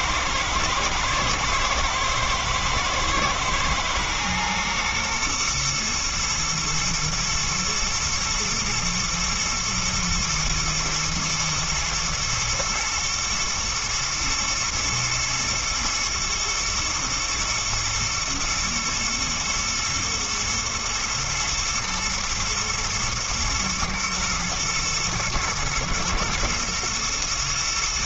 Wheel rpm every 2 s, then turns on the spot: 110, 110, 120, 120, 120, 120, 110, 110, 120, 110, 120, 120, 110, 120.
none